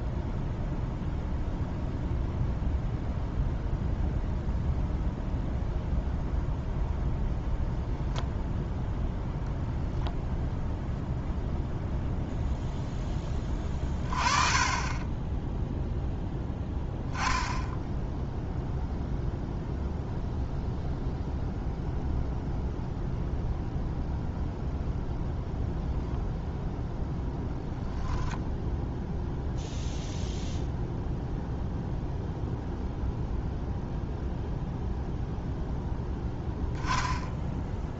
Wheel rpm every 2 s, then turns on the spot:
0, 0, 0, 0, 0, 0, 0, 20, 0, 0, 0, 0, 0, 0, 0, 0, 0, 0, 10.
none